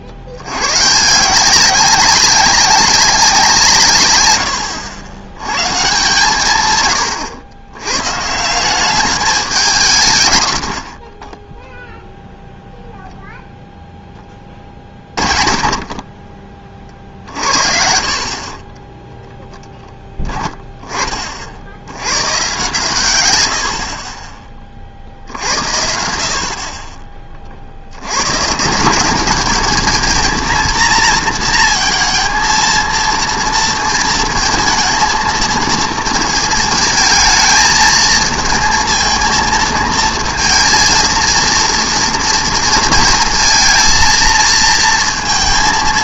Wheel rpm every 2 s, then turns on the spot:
90, 190, 90, 120, 180, 70, 0, 30, 40, 30, 10, 120, 30, 30, 150, 230, 230, 220, 220, 220, 230, 230, 230.
18-20